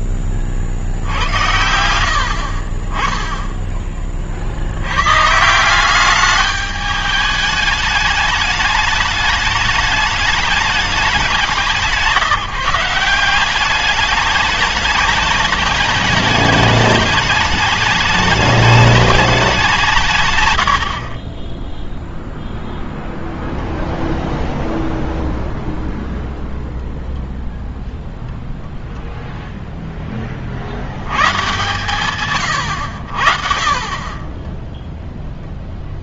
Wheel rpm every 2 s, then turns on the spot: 10, 80, 30, 190, 210, 210, 160, 190, 210, 210, 170, 10, 0, 0, 0, 10, 130, 30.
none